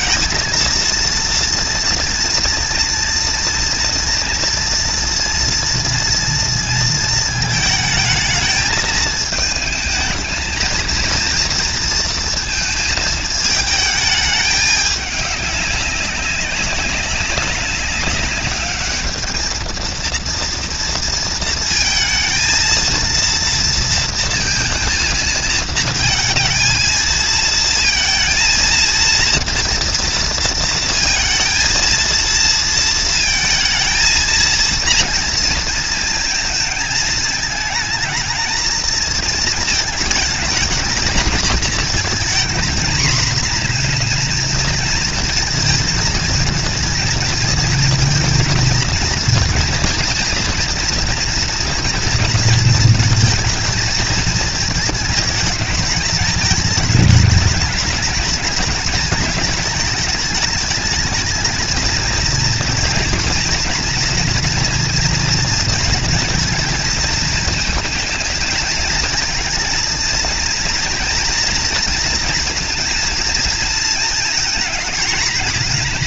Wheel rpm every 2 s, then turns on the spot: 230, 230, 230, 230, 220, 220, 220, 210, 200, 200, 230, 230, 230, 220, 230, 230, 230, 230, 230, 230, 230, 230, 230, 230, 230, 230, 230, 220, 210, 210, 210, 230, 230, 230, 220, 230, 230, 230.
none